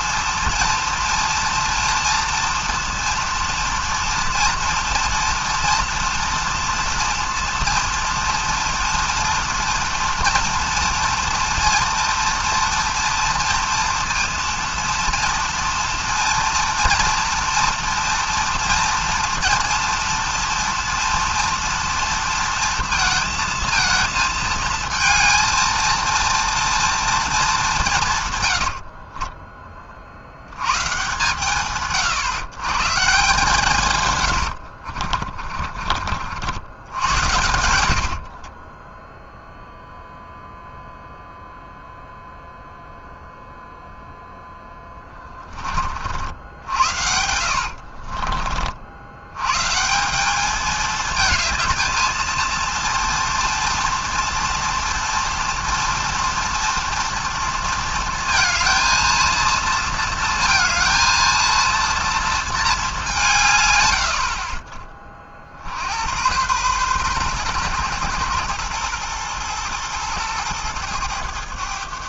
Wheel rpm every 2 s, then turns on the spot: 230, 230, 230, 230, 230, 240, 230, 230, 230, 230, 230, 230, 220, 230, 80, 120, 140, 70, 80, 10, 0, 0, 20, 90, 50, 210, 230, 230, 240, 230, 230, 220, 30, 120, 120, 110.
28-30 34-36 38-40 44-48